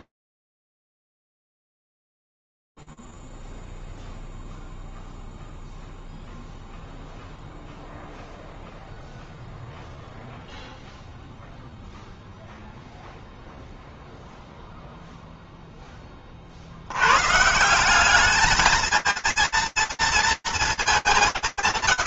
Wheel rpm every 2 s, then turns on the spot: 0, 0, 0, 0, 0, 0, 0, 0, 70, 220, 200.
none